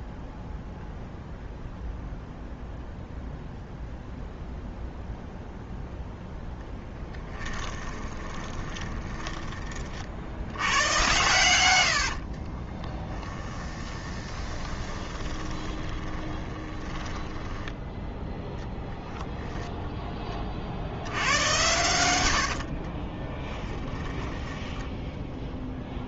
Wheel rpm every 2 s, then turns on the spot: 0, 0, 0, 10, 10, 100, 20, 20, 10, 0, 70, 30, 10.
6-10 12-18 22-26